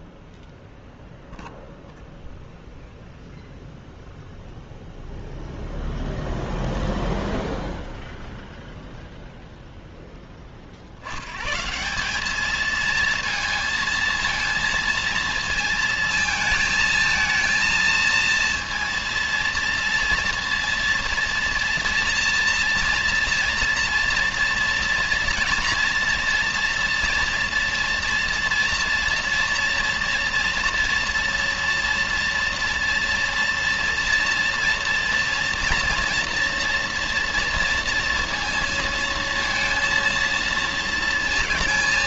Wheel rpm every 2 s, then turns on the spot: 0, 0, 0, 0, 0, 40, 220, 230, 220, 230, 230, 230, 230, 230, 230, 230, 230, 240, 230, 230, 230.
none